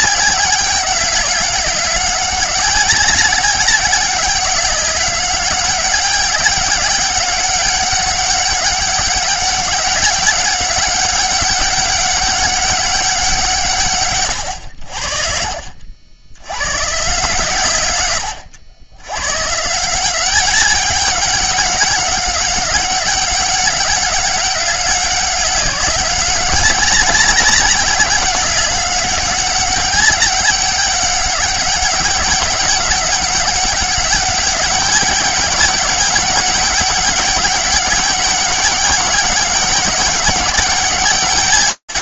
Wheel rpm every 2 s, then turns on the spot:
200, 200, 200, 200, 200, 200, 200, 80, 120, 100, 200, 200, 200, 200, 200, 200, 200, 200, 200, 200, 200.
none